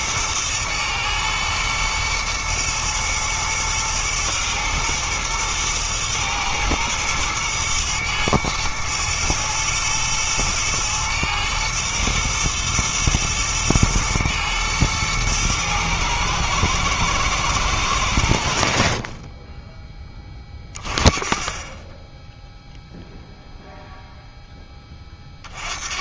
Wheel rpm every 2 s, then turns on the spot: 110, 120, 120, 120, 110, 120, 120, 110, 110, 60, 40, 0, 10.
none